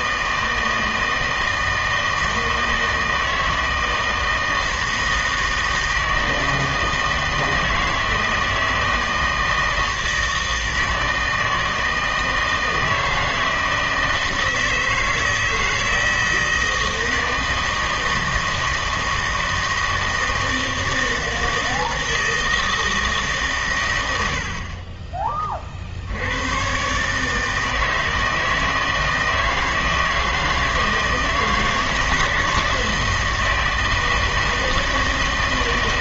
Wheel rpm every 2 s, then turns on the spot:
160, 160, 160, 160, 160, 160, 160, 160, 160, 160, 160, 160, 70, 100, 160, 160, 160, 160.
none